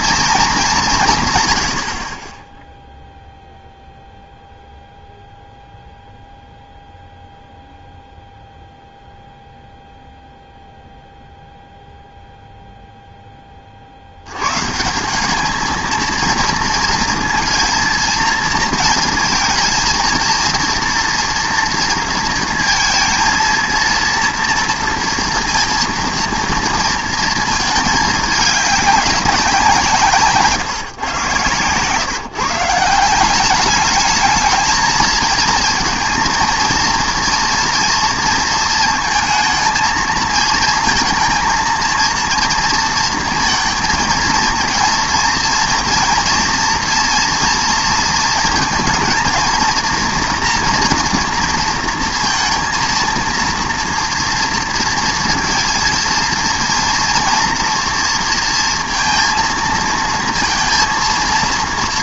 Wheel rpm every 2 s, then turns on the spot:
220, 10, 0, 0, 0, 0, 0, 130, 230, 230, 230, 230, 230, 230, 200, 150, 150, 220, 230, 230, 220, 230, 230, 240, 230, 230, 230, 230, 230, 230, 230.
none